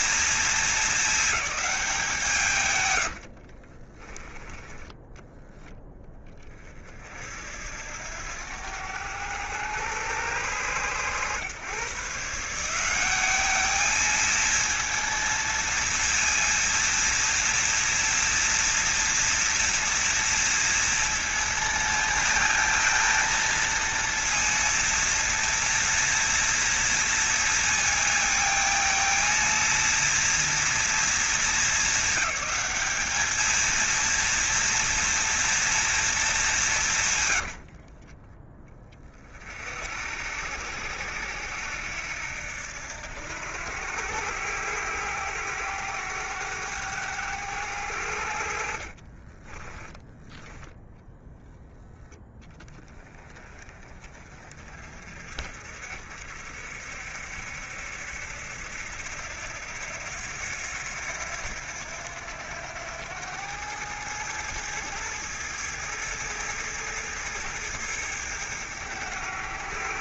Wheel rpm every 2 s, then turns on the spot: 220, 120, 10, 40, 100, 110, 180, 230, 230, 230, 230, 230, 230, 230, 220, 230, 200, 230, 160, 30, 80, 80, 90, 100, 50, 10, 20, 50, 60, 80, 90, 90, 110, 110, 100.
2-4 48-50